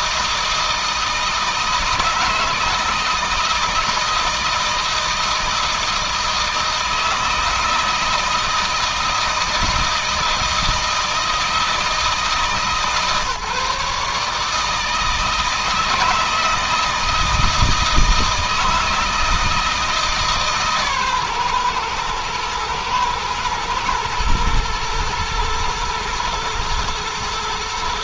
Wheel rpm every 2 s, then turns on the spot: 160, 160, 160, 160, 160, 160, 150, 160, 160, 160, 140, 110, 110, 120.
none